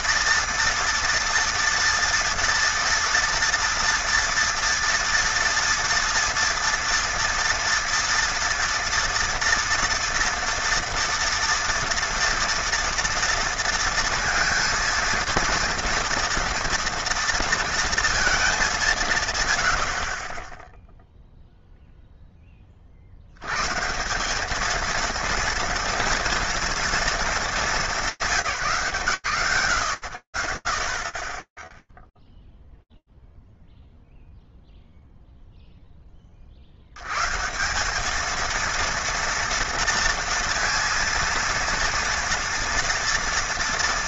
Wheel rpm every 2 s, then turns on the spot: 230, 230, 230, 240, 230, 230, 230, 230, 230, 200, 0, 20, 210, 230, 160, 90, 0, 0, 80, 230, 230, 230.
none